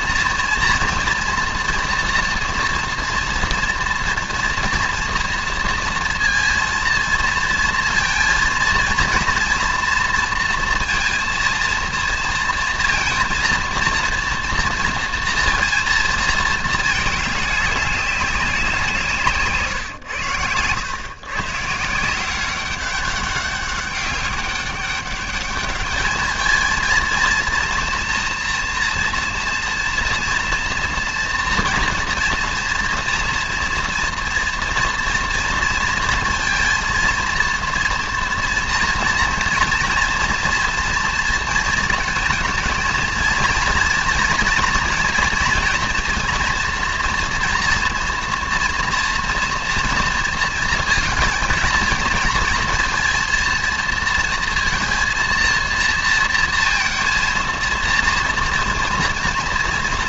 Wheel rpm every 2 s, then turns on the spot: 230, 230, 230, 230, 230, 230, 230, 230, 220, 160, 130, 190, 200, 230, 230, 230, 230, 230, 230, 230, 230, 230, 230, 230, 230, 230, 230, 230, 230, 230.
none